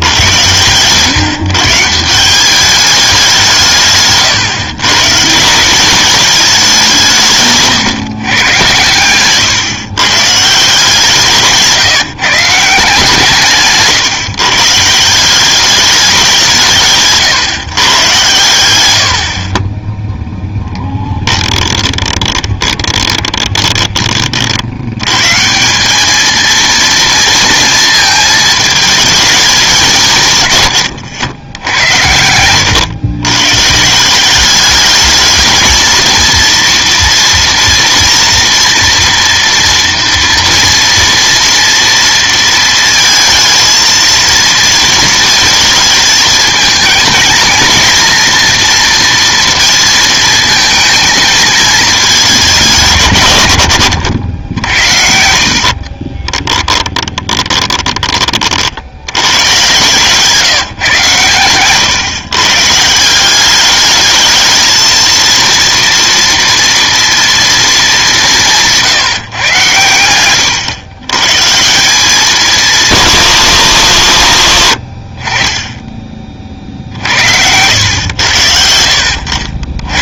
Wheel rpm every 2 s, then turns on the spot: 120, 200, 140, 200, 120, 150, 150, 150, 170, 110, 10, 20, 80, 230, 220, 140, 110, 210, 230, 230, 230, 230, 230, 220, 230, 230, 180, 70, 30, 60, 150, 150, 220, 230, 170, 110, 190, 60, 40, 70.
20-24 56-58 74-76